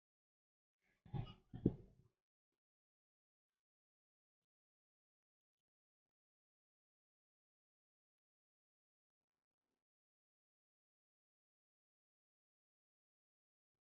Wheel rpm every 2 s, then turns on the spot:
0, 0, 0, 0, 0, 0, 0.
none